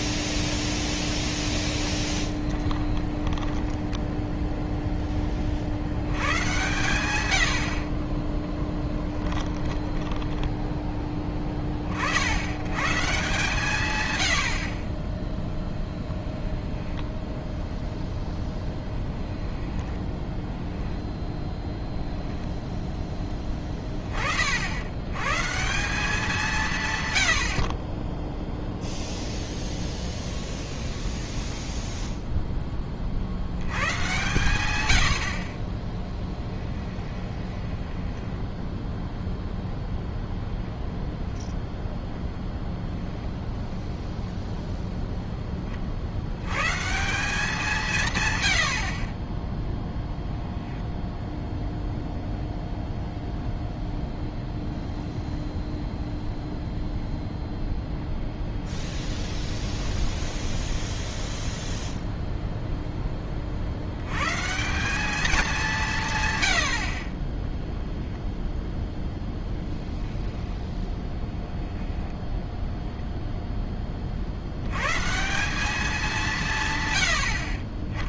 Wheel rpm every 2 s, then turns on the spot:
0, 20, 0, 110, 10, 10, 110, 50, 0, 10, 10, 10, 60, 160, 0, 10, 10, 110, 10, 0, 0, 0, 0, 120, 70, 0, 0, 0, 0, 20, 10, 0, 170, 90, 0, 10, 0, 100, 140.
2-4 8-12 20-24 30-32 36-38 58-62